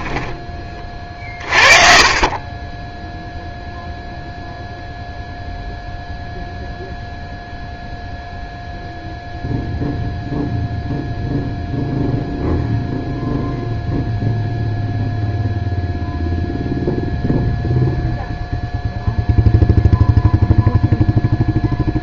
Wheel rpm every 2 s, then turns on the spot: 30, 10, 0, 0, 0, 0, 0, 0, 0, 0, 0.
none